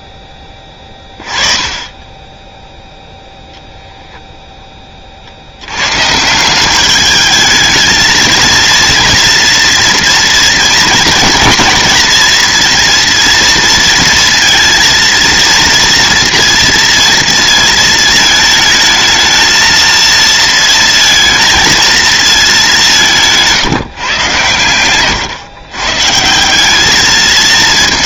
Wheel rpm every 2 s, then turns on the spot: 20, 0, 10, 190, 230, 230, 230, 230, 230, 220, 230, 190, 110, 190.
24-26